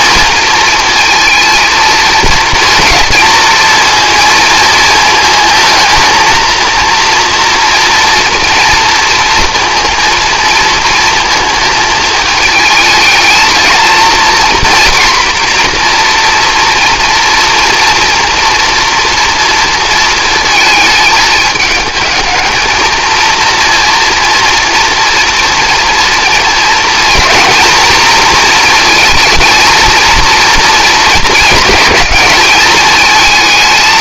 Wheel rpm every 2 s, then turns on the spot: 230, 230, 220, 230, 230, 230, 220, 240, 240, 230, 220, 220, 230, 230, 230, 230, 220.
none